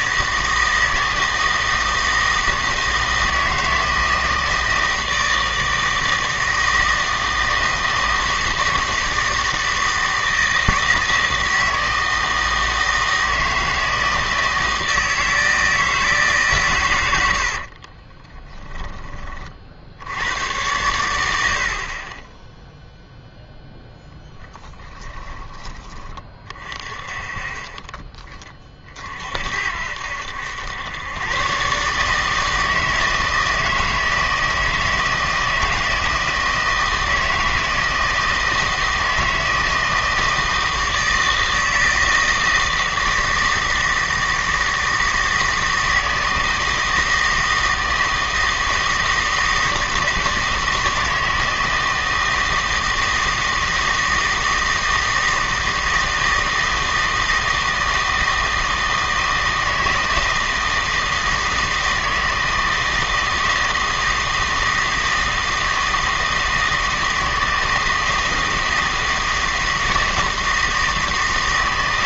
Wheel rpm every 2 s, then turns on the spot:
160, 160, 160, 160, 160, 160, 160, 160, 130, 20, 100, 0, 10, 30, 30, 90, 160, 160, 160, 160, 160, 160, 160, 160, 160, 160, 160, 160, 160, 160, 160, 160, 160, 160, 160, 160.
18-20 24-26